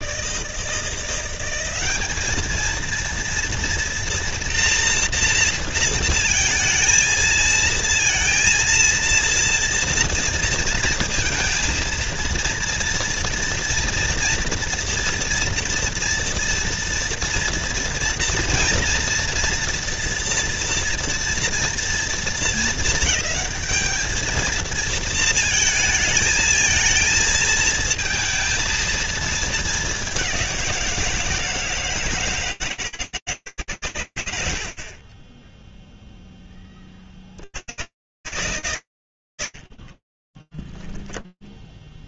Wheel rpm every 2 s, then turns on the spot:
160, 220, 240, 230, 220, 230, 230, 230, 240, 230, 230, 230, 220, 220, 230, 190, 150, 60, 20, 150, 20.
40-42